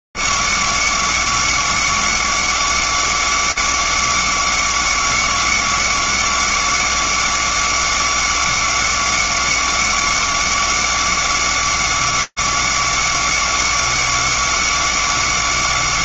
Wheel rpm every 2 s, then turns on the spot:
180, 180, 180, 180, 180, 180, 180, 190.
none